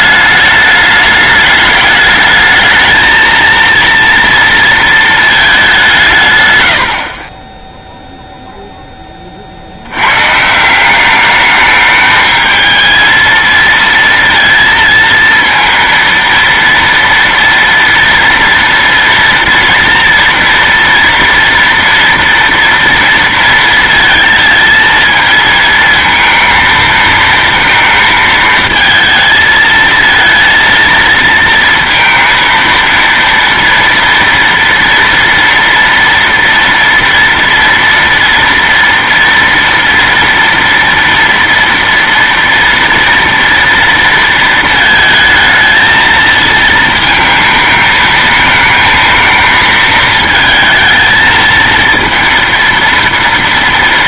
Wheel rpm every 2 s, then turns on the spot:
210, 220, 230, 100, 0, 150, 220, 230, 230, 240, 230, 230, 230, 230, 230, 230, 230, 230, 230, 230, 230, 230, 230, 220, 220, 220, 230.
none